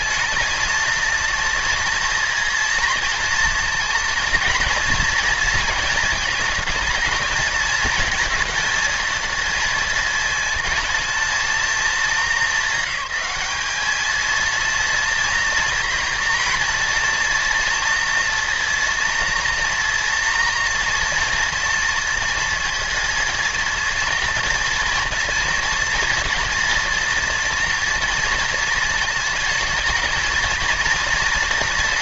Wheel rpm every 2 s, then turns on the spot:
220, 230, 230, 220, 230, 220, 200, 230, 240, 230, 230, 230, 230, 230, 230, 230.
none